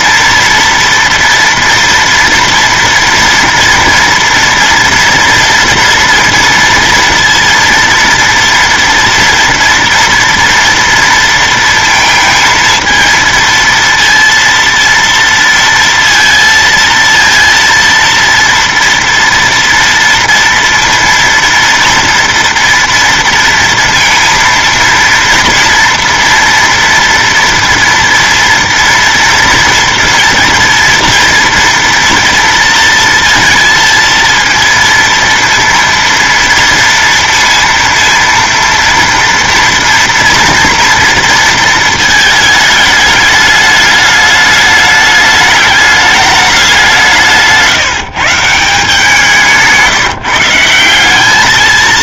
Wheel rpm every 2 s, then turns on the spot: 230, 230, 230, 230, 230, 230, 230, 230, 230, 230, 230, 230, 230, 230, 230, 230, 230, 230, 230, 230, 230, 210, 210, 180, 160, 170.
none